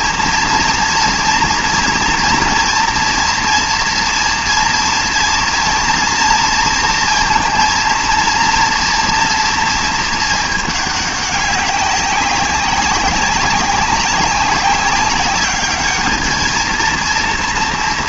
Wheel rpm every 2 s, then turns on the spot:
230, 230, 230, 230, 230, 220, 200, 190, 220.
none